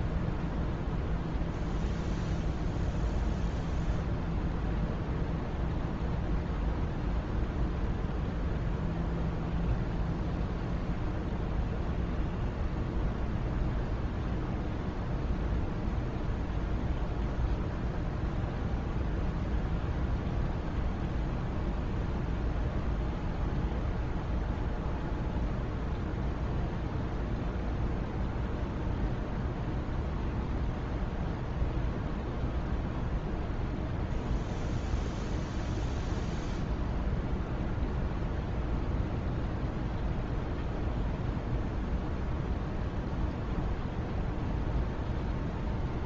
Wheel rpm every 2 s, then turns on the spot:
0, 0, 0, 0, 0, 0, 0, 0, 0, 0, 0, 0, 0, 0, 0, 0, 0, 0, 0, 0, 0, 0, 0.
none